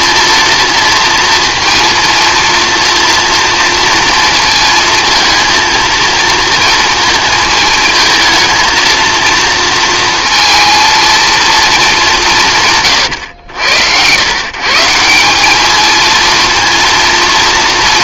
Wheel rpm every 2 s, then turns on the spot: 230, 230, 220, 230, 230, 230, 140, 150, 230.
none